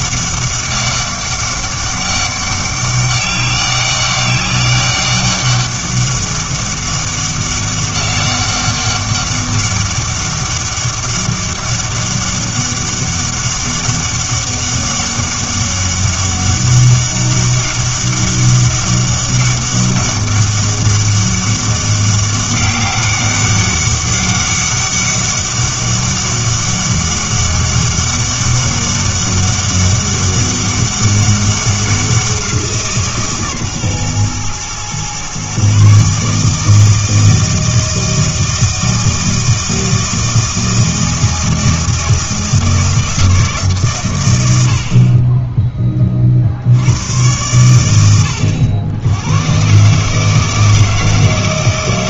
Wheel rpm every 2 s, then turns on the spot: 200, 190, 200, 200, 200, 200, 200, 200, 200, 200, 200, 200, 200, 200, 200, 200, 160, 120, 160, 160, 160, 160, 70, 80, 90, 160.
none